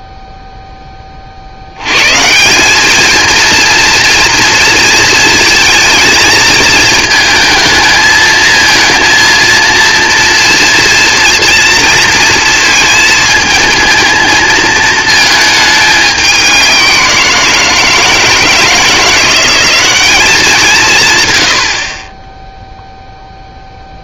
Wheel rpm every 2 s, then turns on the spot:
10, 180, 230, 220, 220, 230, 230, 220, 190, 170, 200, 0.
none